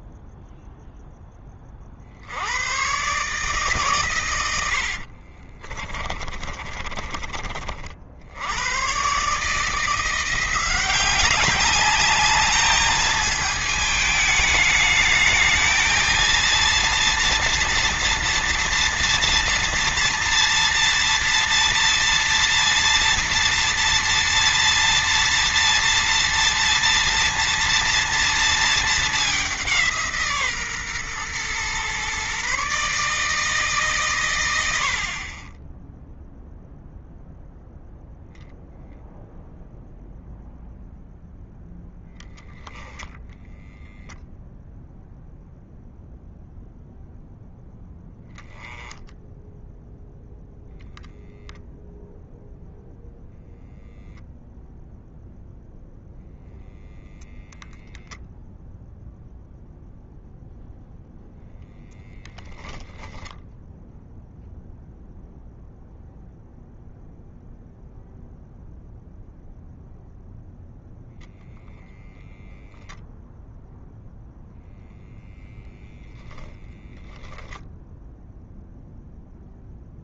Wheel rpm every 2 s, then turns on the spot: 0, 100, 80, 30, 100, 180, 210, 220, 230, 230, 230, 230, 230, 240, 220, 140, 140, 80, 0, 0, 0, 0, 0, 0, 10, 0, 0, 0, 0, 0, 0, 0, 0, 0, 0, 0, 0, 0, 0, 0.
4-8